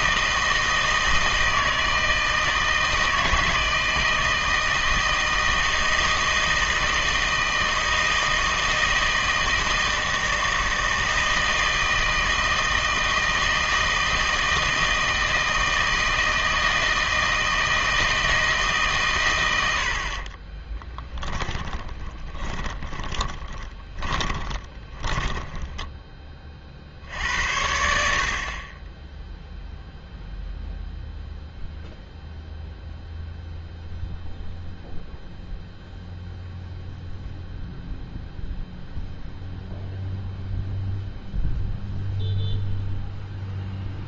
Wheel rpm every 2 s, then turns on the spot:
160, 160, 160, 160, 160, 160, 160, 160, 160, 140, 20, 20, 20, 60, 20, 0, 0, 0, 0, 0, 0, 0.
20-26